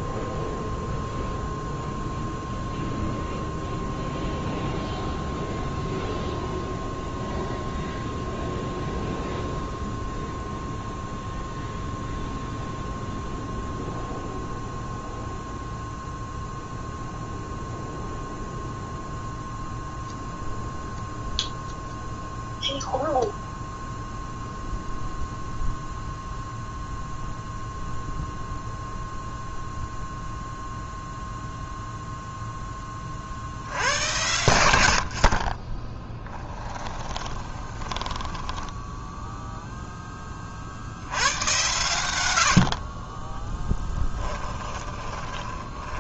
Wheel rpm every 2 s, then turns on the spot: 0, 0, 0, 0, 0, 0, 0, 0, 0, 0, 0, 0, 0, 0, 0, 0, 10, 100, 20, 10, 50, 50, 20.
36-40 44-46